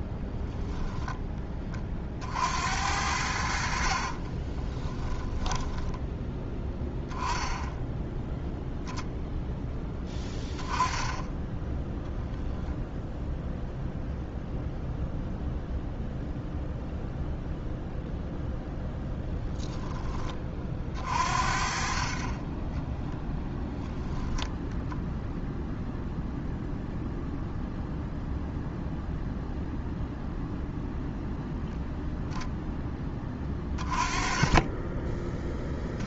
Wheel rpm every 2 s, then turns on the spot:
10, 70, 10, 10, 0, 20, 0, 0, 0, 0, 40, 10, 0, 0, 0, 0, 10, 20.
4-6 22-24